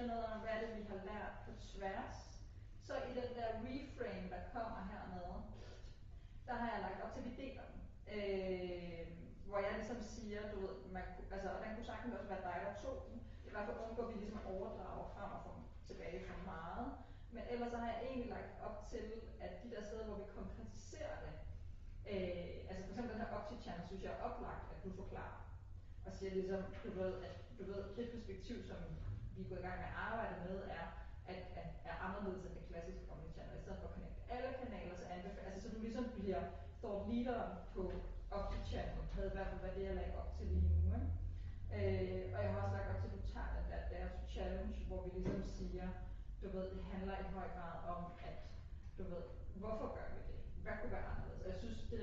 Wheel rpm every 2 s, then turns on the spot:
0, 0, 0, 0, 0, 0, 0, 0, 0, 0, 0, 0, 0, 0, 0, 0, 0, 0, 0, 0, 0, 0, 0, 0, 0, 0.
none